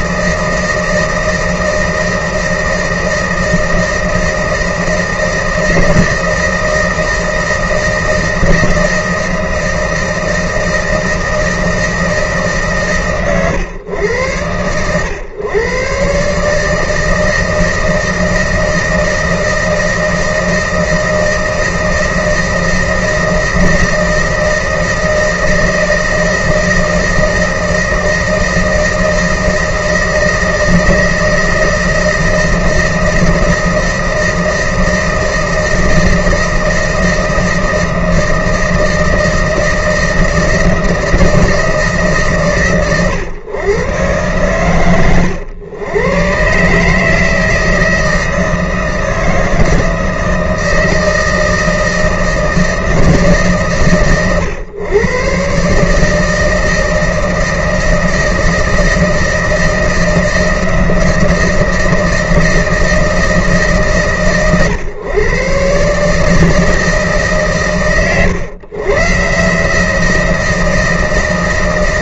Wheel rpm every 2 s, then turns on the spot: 160, 160, 160, 160, 170, 160, 150, 110, 140, 160, 160, 160, 160, 160, 160, 160, 160, 160, 160, 160, 160, 120, 120, 130, 160, 160, 160, 110, 160, 160, 160, 160, 110, 150, 110, 160.
none